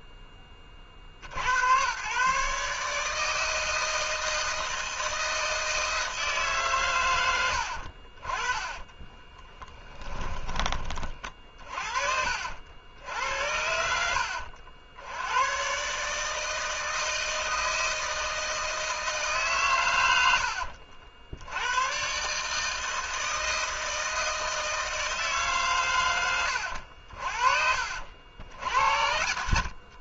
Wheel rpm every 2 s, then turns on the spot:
20, 130, 160, 150, 30, 20, 50, 90, 160, 160, 70, 150, 160, 90, 70.
8-10 20-22